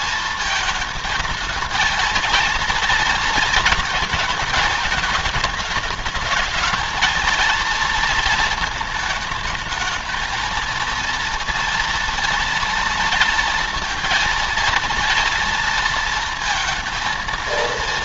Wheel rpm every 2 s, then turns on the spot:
220, 230, 220, 210, 220, 220, 230, 230, 230.
none